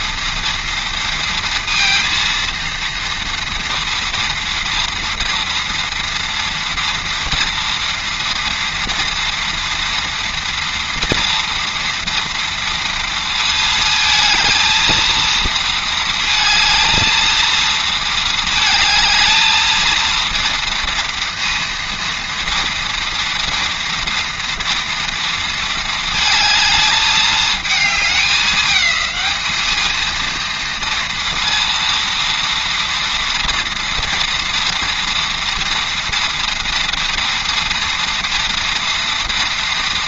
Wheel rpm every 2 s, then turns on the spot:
230, 230, 230, 230, 230, 230, 230, 230, 230, 220, 230, 230, 230, 220, 210, 230, 230, 230, 230, 230.
none